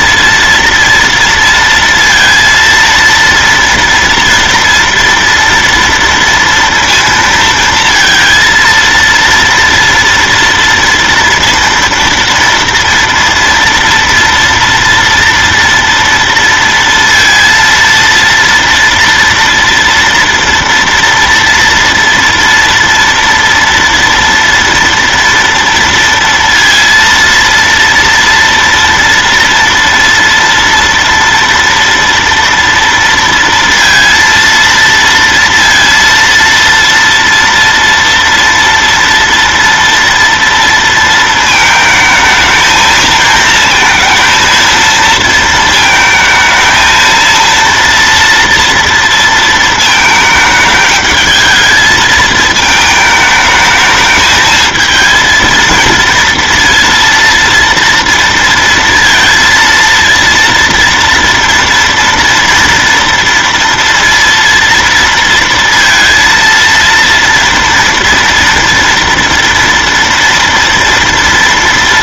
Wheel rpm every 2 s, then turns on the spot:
230, 230, 230, 230, 230, 230, 230, 230, 230, 230, 230, 230, 230, 230, 230, 230, 230, 230, 230, 230, 230, 220, 230, 220, 230, 220, 220, 220, 230, 230, 230, 230, 230, 230, 230, 230.
none